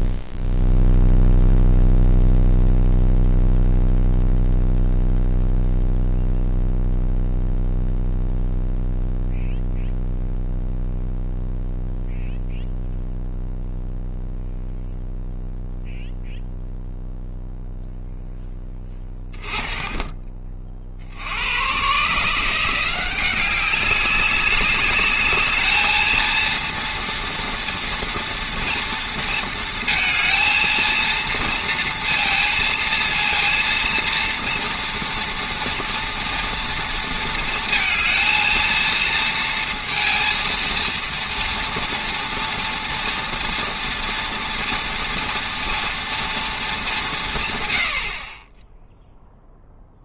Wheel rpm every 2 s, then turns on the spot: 0, 0, 0, 0, 0, 0, 0, 0, 0, 10, 40, 170, 200, 230, 230, 230, 230, 240, 230, 230, 230, 230, 230, 210, 10.
none